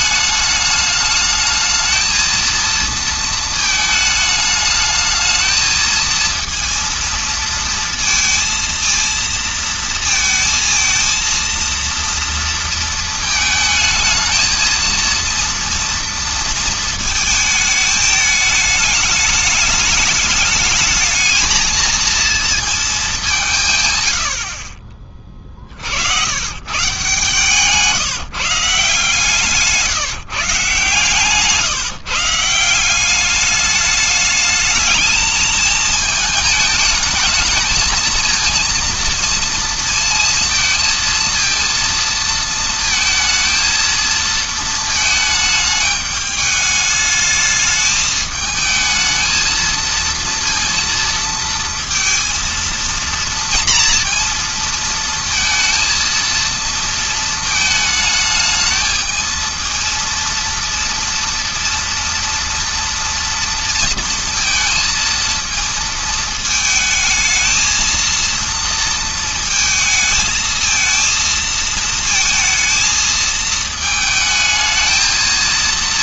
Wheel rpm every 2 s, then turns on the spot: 210, 230, 210, 230, 230, 230, 230, 230, 220, 210, 220, 220, 50, 130, 160, 140, 170, 210, 220, 230, 230, 230, 220, 210, 220, 230, 230, 230, 230, 220, 230, 230, 230, 220, 230, 230, 220, 220.
none